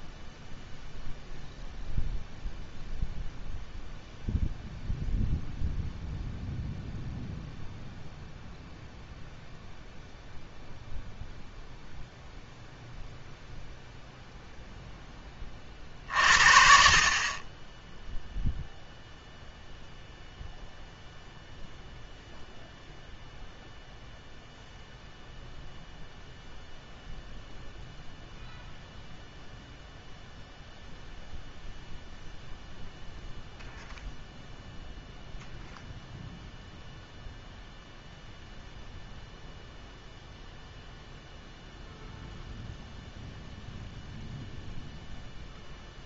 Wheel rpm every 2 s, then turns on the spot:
0, 0, 0, 0, 0, 0, 0, 0, 50, 0, 0, 0, 0, 0, 0, 0, 0, 0, 0, 0, 0, 0, 0.
none